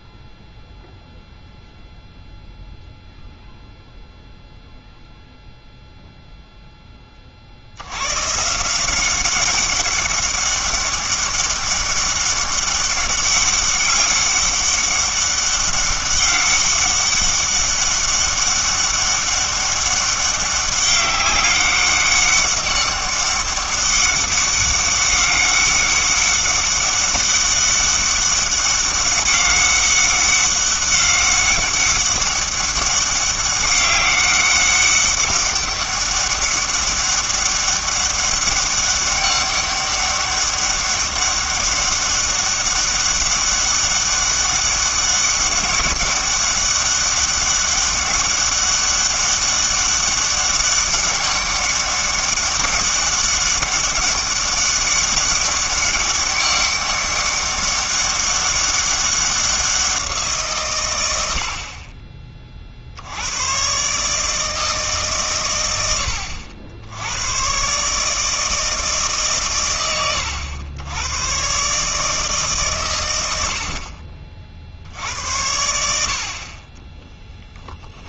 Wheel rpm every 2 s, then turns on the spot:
0, 0, 0, 10, 170, 200, 200, 200, 200, 200, 200, 200, 200, 200, 200, 200, 200, 200, 200, 200, 200, 200, 200, 200, 200, 200, 200, 200, 200, 200, 140, 50, 150, 80, 160, 100, 140, 60, 30.
none